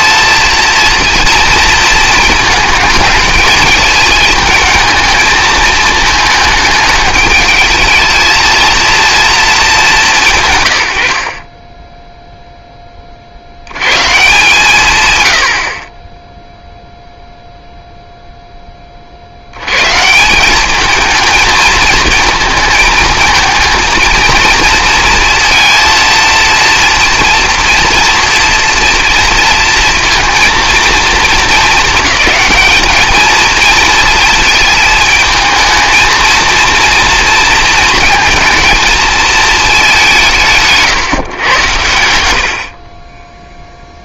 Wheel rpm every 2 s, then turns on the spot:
230, 210, 220, 220, 220, 120, 10, 180, 0, 10, 190, 220, 230, 230, 240, 230, 210, 220, 230, 220, 160, 70.
none